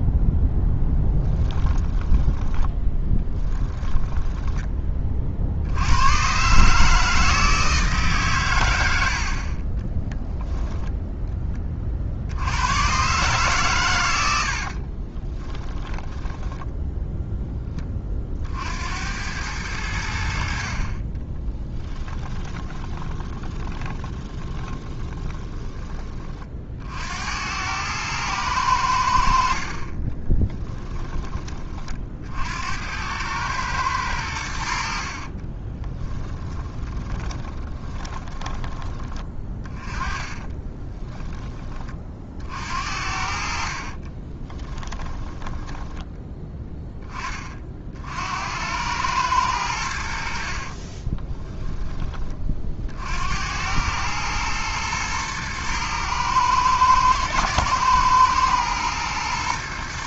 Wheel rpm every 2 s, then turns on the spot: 10, 20, 20, 140, 100, 10, 90, 60, 0, 60, 50, 10, 20, 50, 90, 10, 70, 70, 20, 10, 20, 60, 20, 20, 90, 50, 40, 110, 110, 110.
2-6 14-16 22-26 30-32 36-38 40-42 44-46 50-52